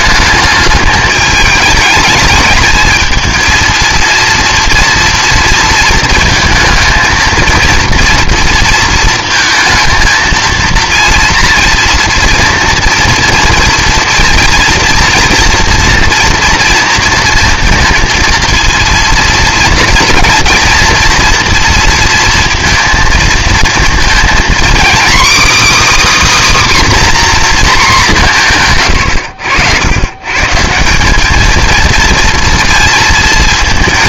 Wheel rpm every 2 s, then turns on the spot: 210, 220, 230, 220, 230, 220, 230, 230, 230, 230, 230, 230, 250, 290, 150, 160, 230.
none